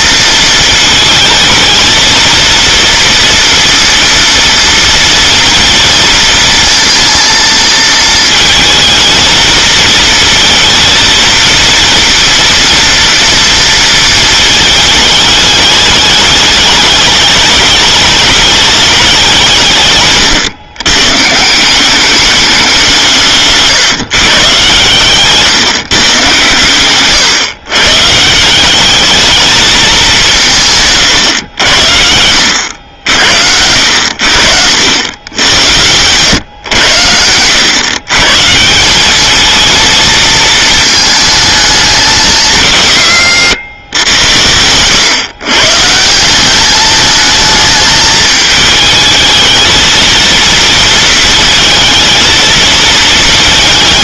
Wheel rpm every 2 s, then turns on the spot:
220, 230, 230, 230, 230, 230, 230, 220, 210, 210, 120, 190, 140, 120, 190, 150, 80, 80, 110, 160, 220, 120, 110, 200, 220, 230, 230.
none